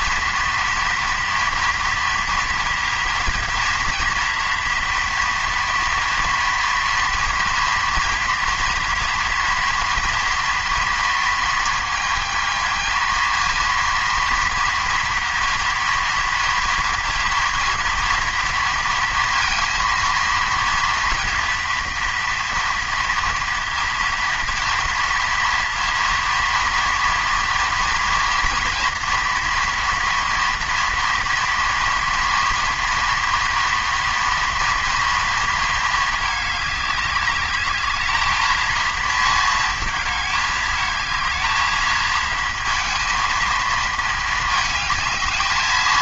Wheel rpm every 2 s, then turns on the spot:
230, 230, 230, 230, 230, 230, 220, 230, 230, 230, 230, 230, 230, 230, 230, 230, 230, 230, 200, 230, 220, 230, 220.
none